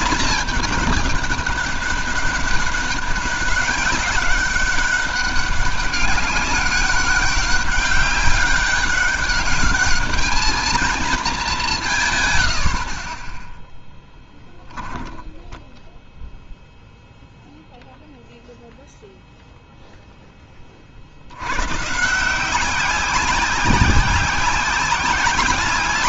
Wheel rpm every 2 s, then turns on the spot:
220, 200, 190, 200, 200, 220, 90, 10, 0, 0, 30, 180, 190.
none